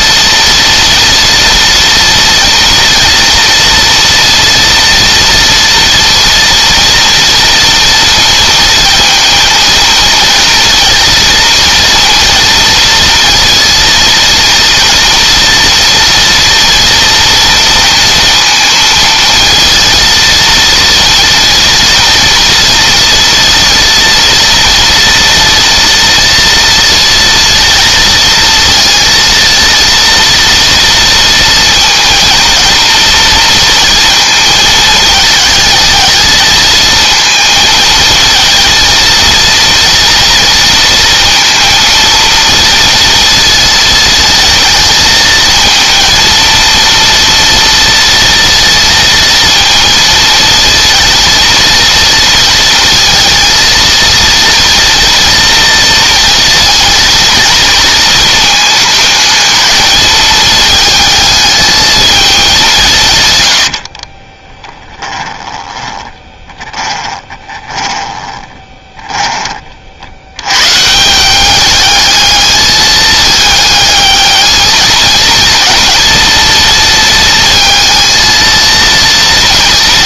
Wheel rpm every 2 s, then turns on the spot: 230, 240, 240, 230, 230, 230, 230, 230, 230, 230, 230, 230, 230, 230, 230, 230, 230, 220, 220, 230, 230, 230, 220, 230, 230, 230, 230, 230, 230, 220, 220, 200, 20, 20, 20, 110, 220, 220, 230, 230.
64-70